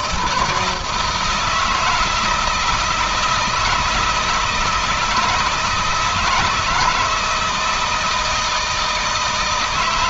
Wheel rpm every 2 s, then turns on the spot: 170, 160, 160, 160, 160.
none